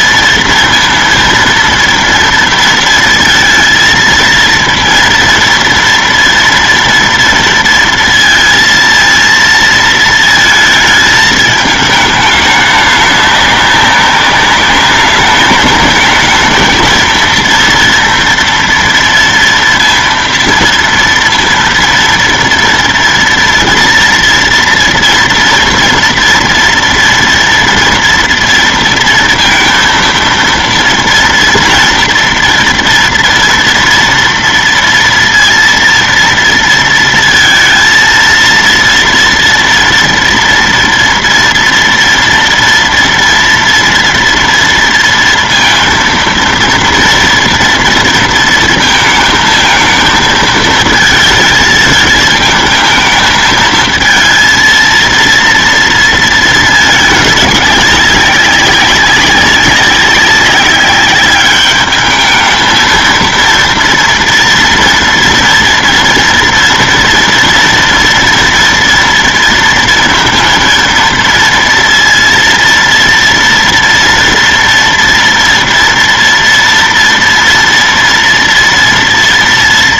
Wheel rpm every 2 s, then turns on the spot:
230, 230, 230, 230, 230, 220, 210, 200, 220, 230, 230, 240, 230, 230, 230, 230, 230, 230, 230, 230, 240, 230, 230, 230, 230, 220, 220, 230, 210, 200, 200, 220, 230, 230, 230, 230, 230, 230, 230, 230.
none